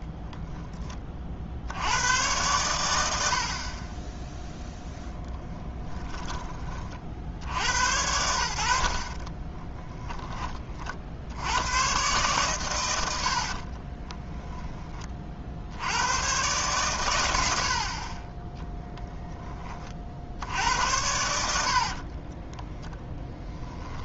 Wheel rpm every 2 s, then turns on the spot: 10, 110, 10, 20, 70, 30, 120, 10, 120, 10, 80, 10.
4-8 22-24